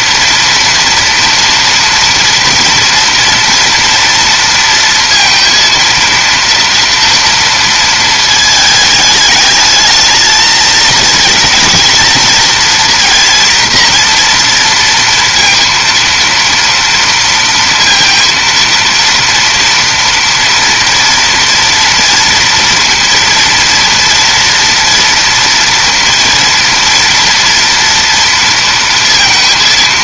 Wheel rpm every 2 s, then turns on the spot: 230, 230, 230, 230, 220, 220, 230, 230, 230, 230, 230, 230, 230, 230, 230.
none